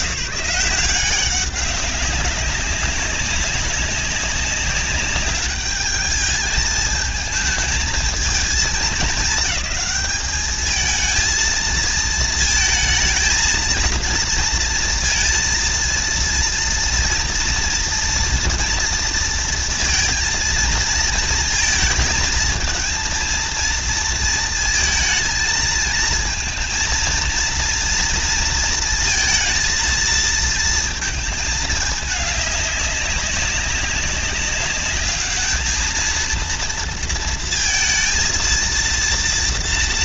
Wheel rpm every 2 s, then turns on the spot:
170, 190, 190, 220, 220, 210, 220, 230, 230, 230, 230, 230, 230, 230, 230, 230, 200, 200, 230, 230.
none